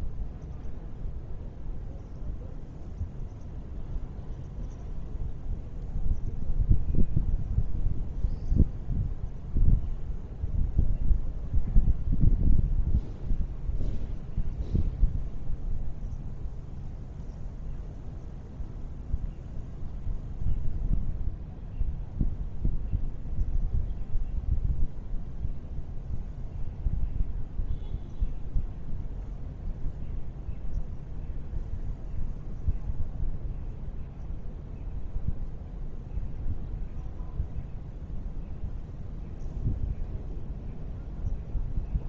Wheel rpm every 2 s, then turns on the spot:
0, 0, 0, 0, 0, 0, 0, 0, 0, 0, 0, 0, 0, 0, 0, 0, 0, 0, 0, 0, 0.
none